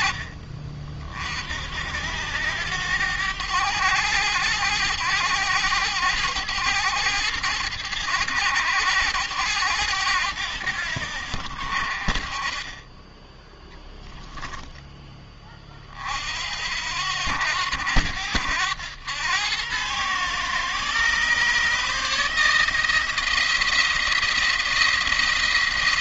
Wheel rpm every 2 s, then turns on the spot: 40, 100, 100, 100, 100, 90, 30, 10, 70, 90, 130, 160, 170.
none